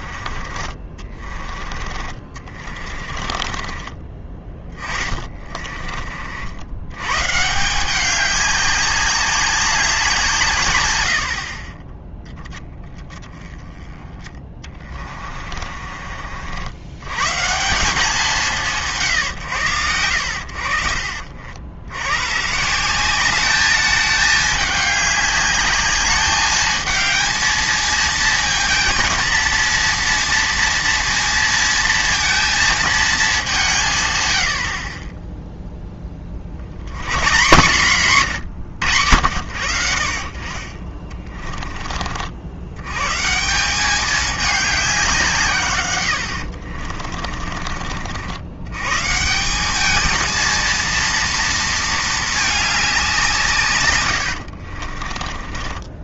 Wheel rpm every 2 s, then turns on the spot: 40, 30, 20, 100, 200, 120, 20, 30, 100, 160, 50, 170, 210, 220, 230, 230, 230, 40, 90, 90, 40, 110, 200, 50, 110, 230, 200, 50.
0-6 14-16 40-42 46-48 54-56